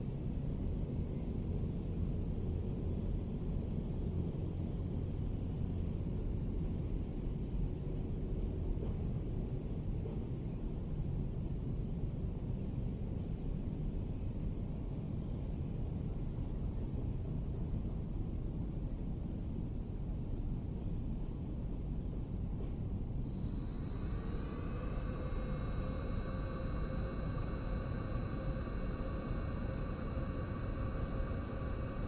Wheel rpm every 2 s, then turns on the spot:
0, 0, 0, 0, 0, 0, 0, 0, 0, 0, 0, 0, 0, 0, 0, 0.
none